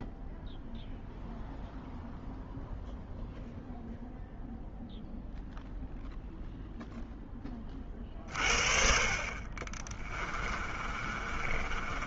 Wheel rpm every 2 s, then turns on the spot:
0, 0, 0, 0, 50, 30.
10-12